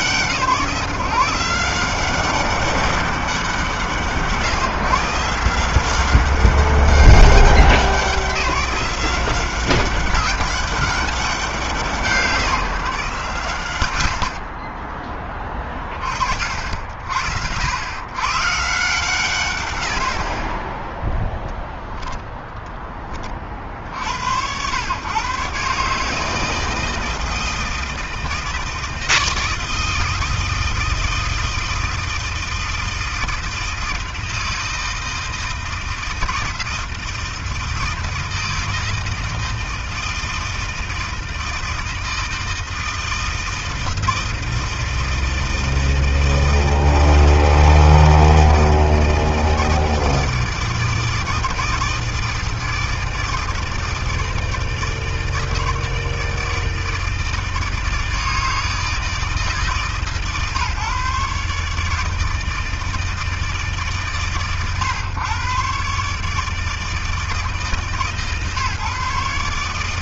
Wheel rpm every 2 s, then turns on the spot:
160, 160, 170, 190, 190, 170, 130, 10, 80, 130, 0, 40, 140, 160, 160, 160, 160, 160, 160, 160, 160, 160, 160, 160, 160, 160, 160, 160, 160, 160, 140, 150, 120, 160, 140.
none